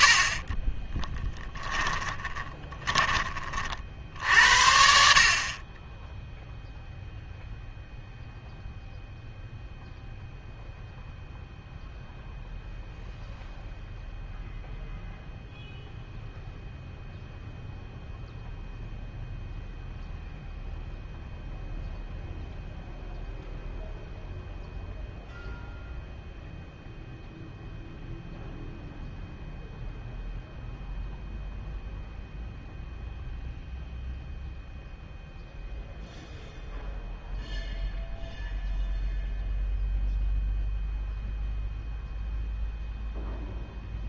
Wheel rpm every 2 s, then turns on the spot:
20, 20, 60, 0, 0, 0, 0, 0, 0, 0, 0, 0, 0, 0, 0, 0, 0, 0, 0, 0, 0, 0.
0-4